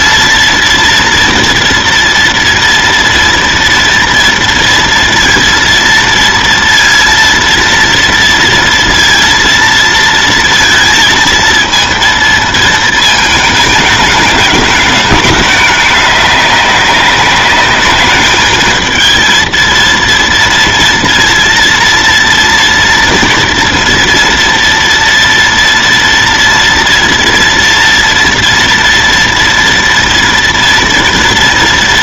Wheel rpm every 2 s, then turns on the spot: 230, 230, 230, 230, 230, 230, 220, 210, 200, 220, 230, 230, 230, 230, 230, 230.
none